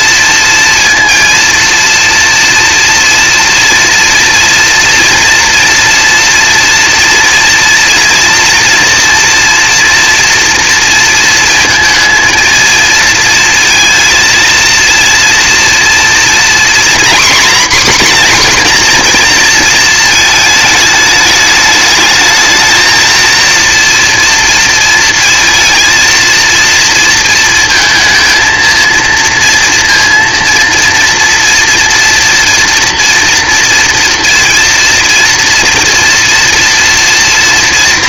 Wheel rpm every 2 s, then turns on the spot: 230, 240, 240, 230, 230, 230, 230, 230, 250, 250, 210, 220, 230, 230, 230, 230, 240, 230, 230.
none